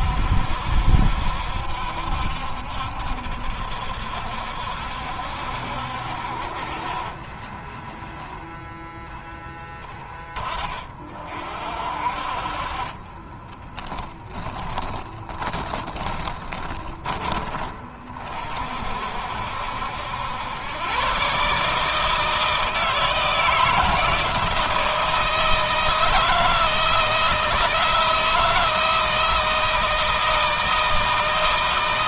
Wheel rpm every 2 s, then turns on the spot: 70, 70, 70, 50, 0, 30, 40, 30, 20, 40, 100, 160, 160, 160, 170, 160.
14-18